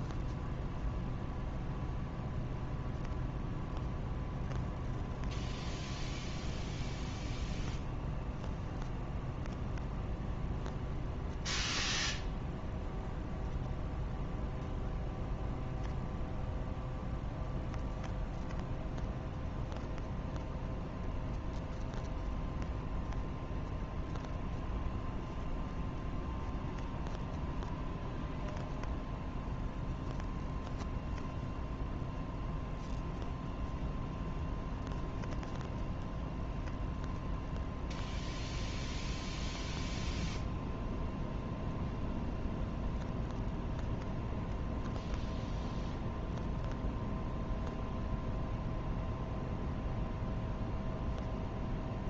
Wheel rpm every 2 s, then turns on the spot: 0, 0, 0, 0, 0, 0, 0, 0, 0, 0, 0, 0, 0, 0, 0, 0, 0, 0, 0, 0, 0, 0, 0, 0, 0, 0.
none